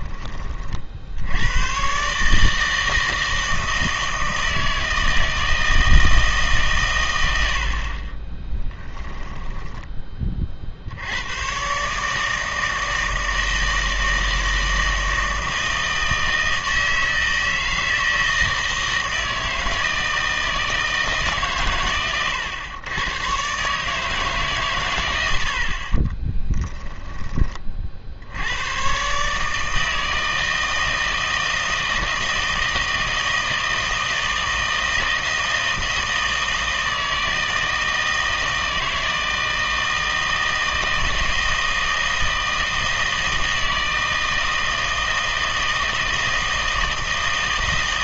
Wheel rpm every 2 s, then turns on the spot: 40, 160, 160, 140, 10, 50, 160, 160, 160, 160, 160, 110, 130, 10, 100, 160, 160, 160, 160, 160, 160, 160, 160, 160.
8-10 26-28